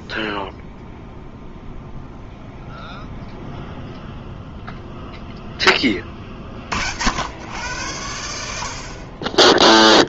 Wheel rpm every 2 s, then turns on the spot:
0, 0, 0, 90, 20.
none